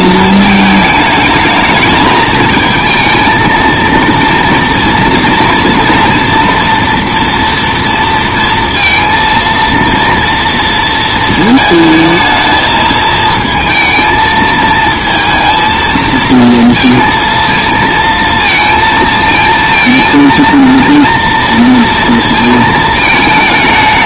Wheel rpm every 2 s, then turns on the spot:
220, 220, 230, 240, 230, 230, 220, 220, 230, 230, 230, 220.
none